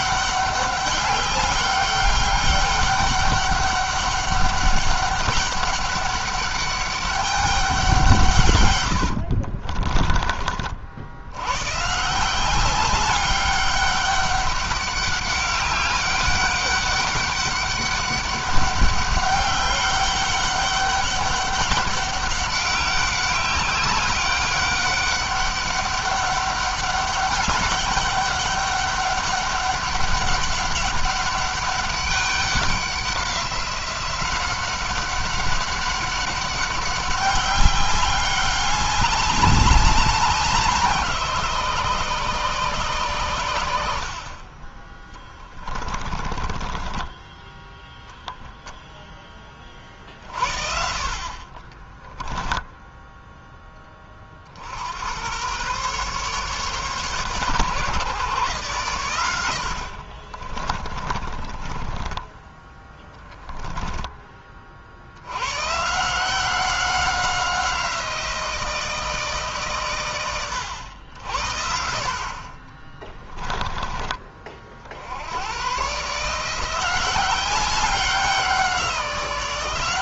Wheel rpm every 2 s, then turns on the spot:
190, 200, 200, 200, 90, 50, 180, 200, 200, 200, 200, 200, 200, 200, 200, 200, 190, 190, 190, 200, 170, 140, 30, 20, 10, 50, 0, 70, 140, 130, 40, 10, 50, 180, 160, 90, 30, 50, 170, 180.
8-10 44-48 60-64